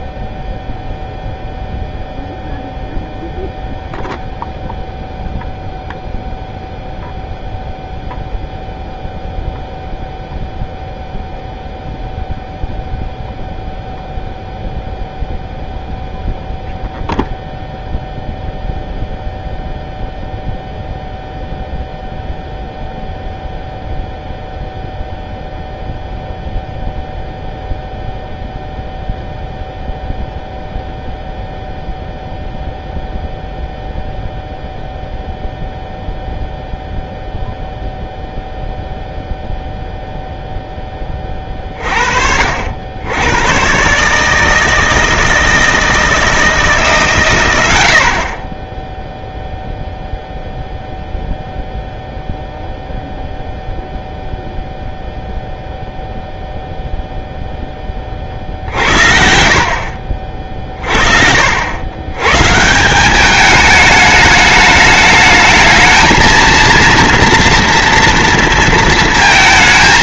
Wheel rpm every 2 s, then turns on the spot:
0, 0, 0, 0, 0, 0, 0, 0, 0, 0, 0, 0, 0, 0, 0, 0, 0, 0, 0, 0, 0, 50, 150, 160, 40, 0, 0, 0, 0, 40, 50, 140, 210, 230, 230.
none